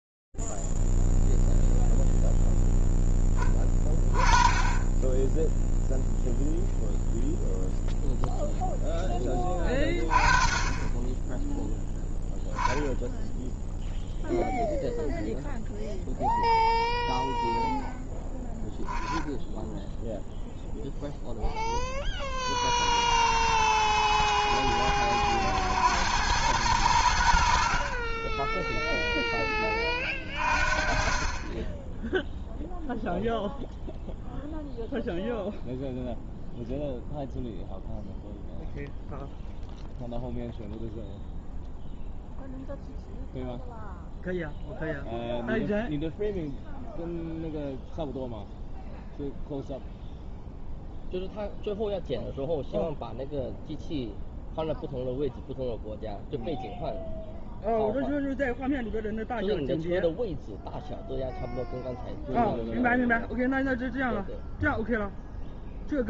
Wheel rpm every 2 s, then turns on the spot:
0, 0, 20, 0, 0, 20, 0, 0, 0, 10, 0, 40, 70, 100, 0, 30, 0, 0, 0, 0, 0, 0, 0, 0, 0, 0, 0, 0, 0, 0, 0, 0, 0.
none